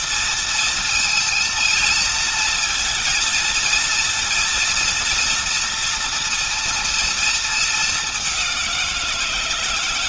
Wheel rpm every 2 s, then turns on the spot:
230, 230, 230, 230, 190.
none